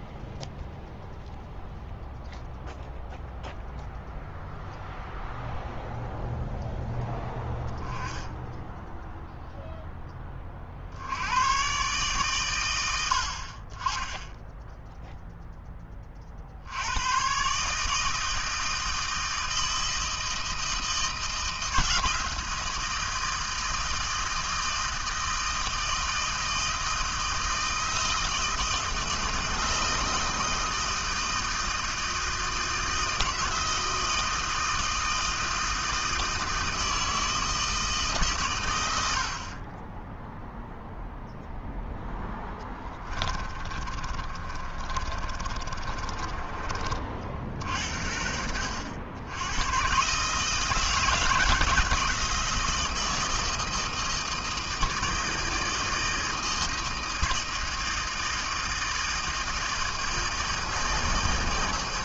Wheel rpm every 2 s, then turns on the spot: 0, 0, 0, 0, 10, 40, 100, 0, 70, 160, 160, 160, 160, 160, 160, 160, 160, 160, 160, 120, 0, 10, 30, 20, 70, 150, 160, 160, 160, 160, 160.
42-46